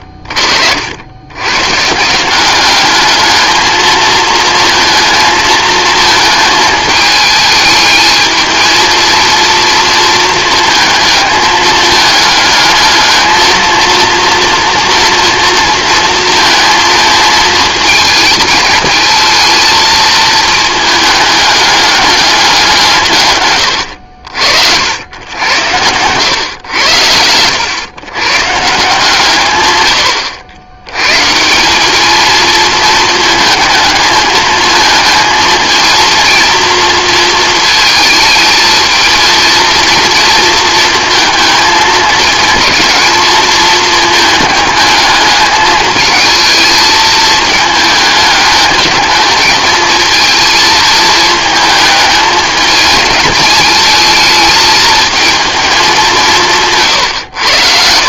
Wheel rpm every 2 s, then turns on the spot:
60, 200, 230, 220, 220, 230, 220, 240, 220, 230, 220, 190, 80, 90, 150, 90, 220, 220, 230, 220, 230, 220, 220, 220, 210, 220, 220, 220, 160.
none